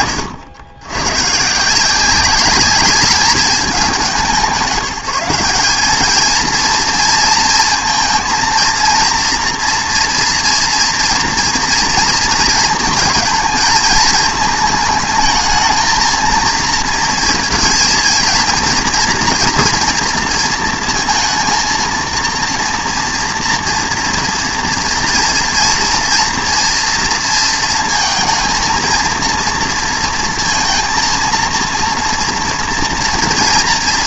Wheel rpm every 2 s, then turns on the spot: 140, 200, 170, 230, 230, 230, 220, 220, 230, 230, 230, 230, 230, 240, 220, 230, 230.
none